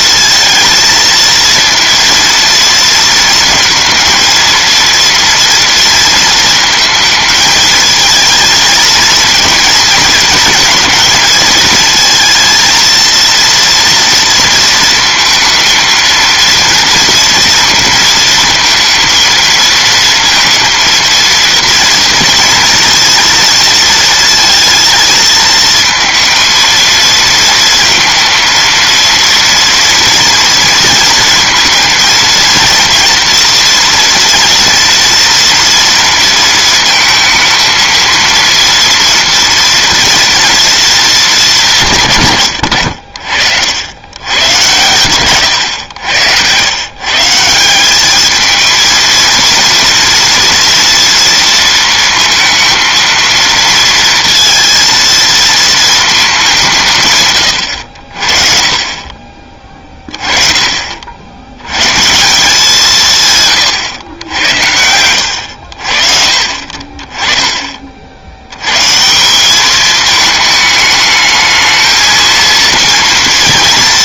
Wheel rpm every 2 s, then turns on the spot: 230, 230, 230, 220, 230, 230, 220, 230, 230, 220, 230, 230, 220, 230, 230, 230, 230, 230, 220, 230, 230, 100, 100, 120, 220, 230, 230, 230, 170, 40, 40, 160, 80, 40, 110, 210, 230.
none